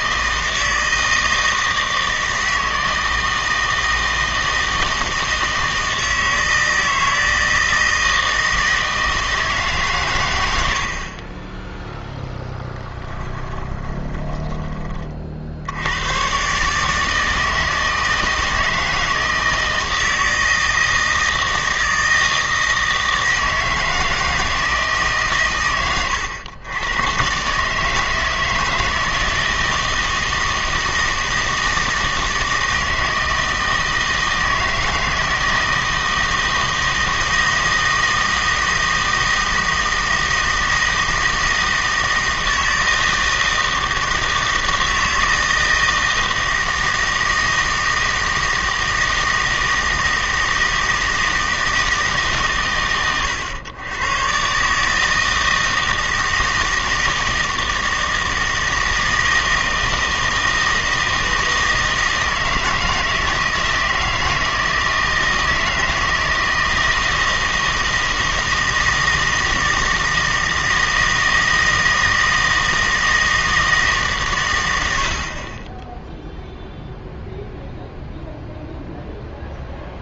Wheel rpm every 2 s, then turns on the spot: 160, 160, 160, 160, 160, 80, 10, 20, 130, 160, 160, 160, 160, 110, 160, 160, 160, 160, 160, 160, 160, 160, 160, 160, 160, 160, 130, 130, 160, 160, 160, 160, 160, 160, 160, 160, 160, 110, 0, 0.
14-16